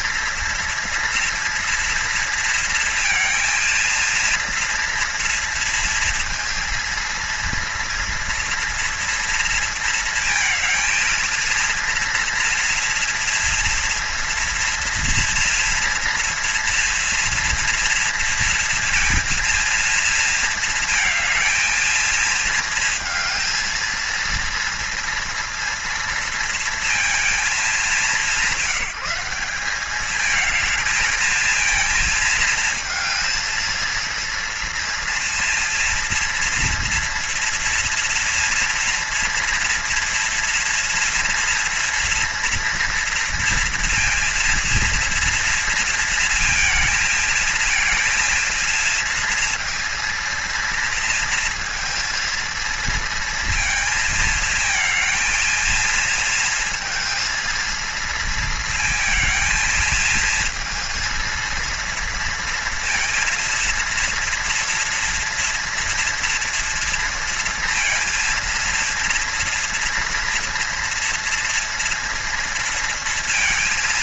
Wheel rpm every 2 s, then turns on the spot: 230, 230, 230, 230, 230, 230, 230, 240, 230, 230, 230, 220, 230, 230, 180, 220, 230, 230, 230, 230, 230, 230, 230, 230, 230, 230, 230, 220, 230, 230, 230, 230, 230, 230, 230, 230, 230.
none